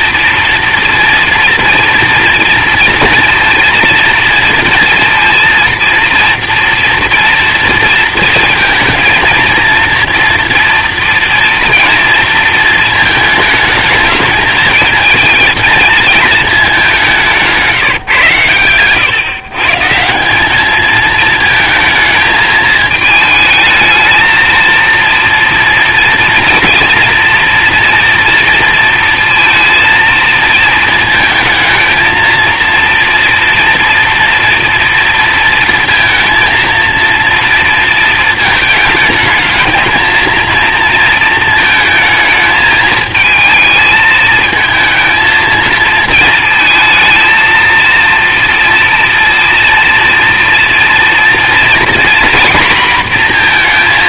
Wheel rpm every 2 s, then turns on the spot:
230, 230, 230, 230, 230, 230, 230, 220, 210, 120, 210, 220, 220, 230, 230, 220, 230, 230, 230, 220, 230, 220, 220, 220, 230, 230, 240.
18-20